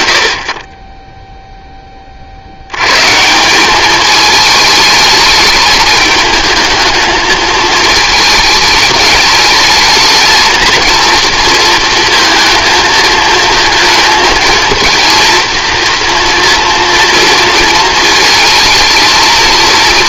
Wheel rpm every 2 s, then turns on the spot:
50, 80, 210, 220, 220, 230, 230, 220, 230, 220.
none